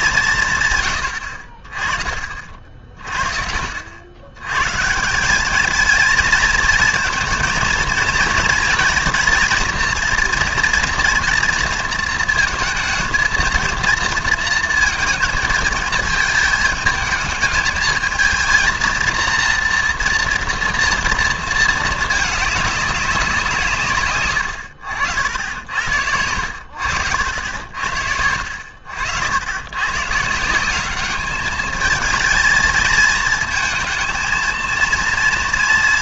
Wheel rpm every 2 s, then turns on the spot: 140, 40, 110, 220, 230, 230, 230, 230, 220, 230, 230, 210, 90, 90, 70, 180, 220, 230.
24-26